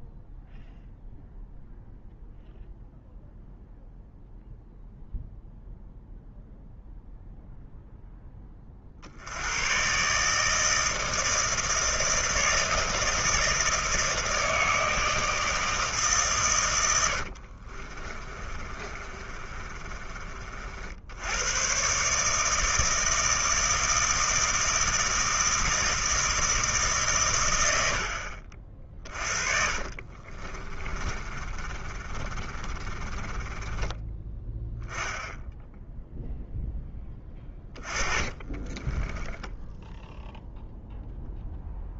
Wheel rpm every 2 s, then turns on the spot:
0, 0, 0, 0, 40, 160, 170, 160, 110, 30, 60, 160, 160, 150, 40, 30, 30, 10, 10, 20, 0.
18-20 30-34 38-40